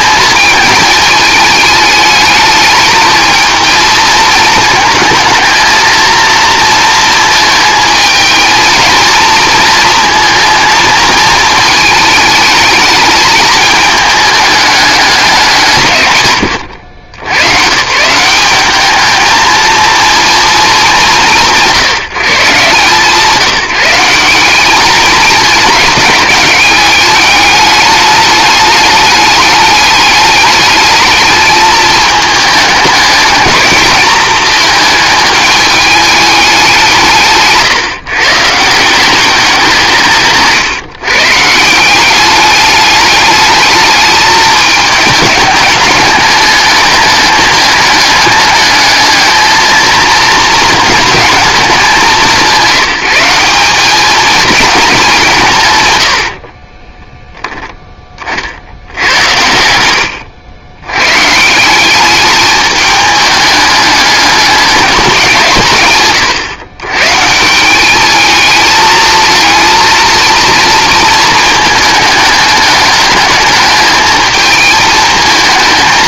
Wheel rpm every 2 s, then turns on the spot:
220, 210, 230, 230, 220, 230, 210, 200, 100, 190, 220, 160, 200, 200, 210, 210, 210, 220, 190, 160, 140, 210, 210, 200, 210, 220, 180, 210, 30, 90, 110, 210, 200, 120, 220, 230, 210, 220.
56-58